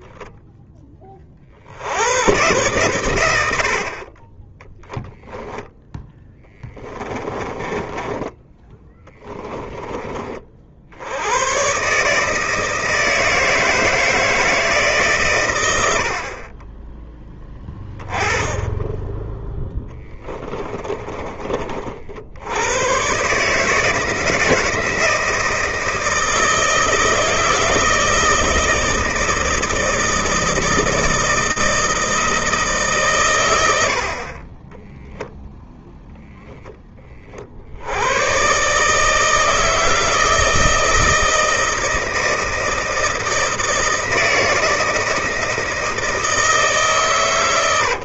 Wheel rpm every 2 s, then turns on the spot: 0, 90, 40, 10, 20, 20, 130, 160, 80, 10, 10, 50, 160, 160, 160, 160, 160, 70, 0, 80, 160, 160, 160, 160.
6-10 16-18 20-22